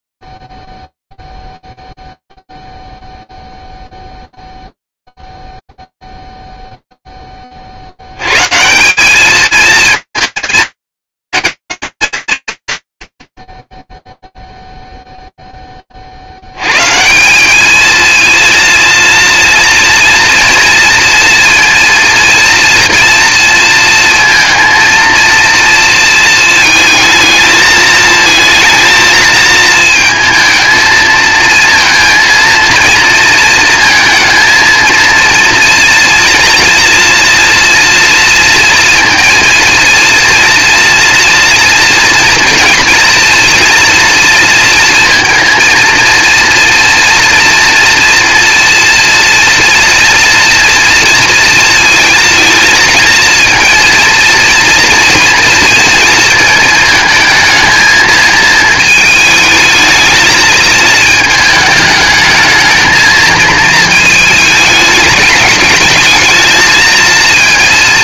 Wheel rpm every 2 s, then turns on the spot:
0, 0, 0, 0, 110, 180, 120, 0, 70, 230, 230, 230, 230, 220, 220, 220, 230, 230, 230, 230, 230, 230, 230, 230, 230, 230, 230, 230, 230, 220, 220, 220, 220, 220.
none